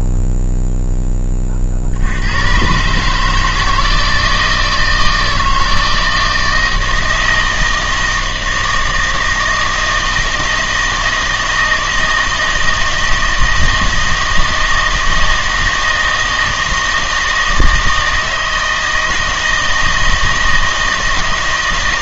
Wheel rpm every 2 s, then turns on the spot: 0, 120, 170, 160, 160, 160, 160, 160, 160, 160, 160.
none